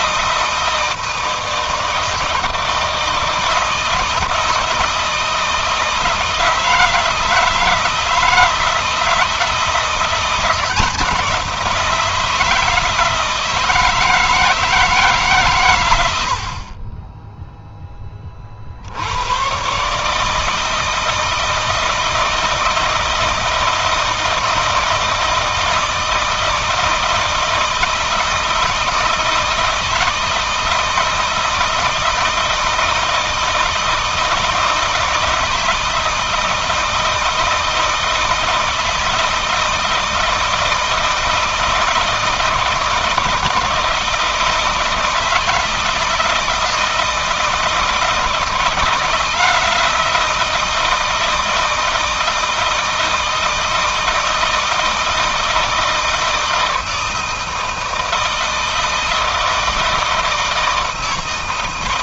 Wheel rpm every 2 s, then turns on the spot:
160, 160, 160, 160, 160, 170, 160, 160, 30, 60, 160, 160, 160, 160, 160, 160, 160, 160, 160, 160, 160, 160, 160, 160, 160, 170, 160, 160, 160, 160, 160.
none